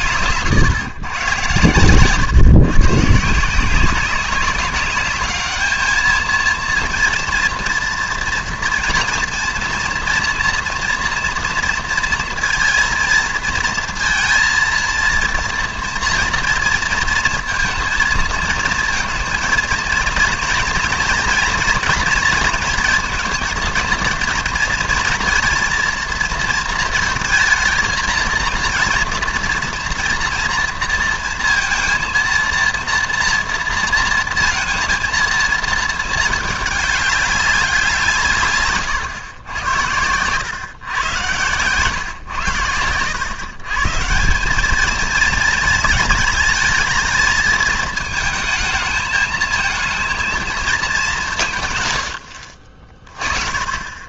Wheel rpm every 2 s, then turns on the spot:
140, 130, 200, 230, 230, 230, 230, 230, 230, 230, 230, 230, 230, 230, 230, 230, 240, 230, 210, 130, 120, 110, 200, 220, 220, 220, 60.
none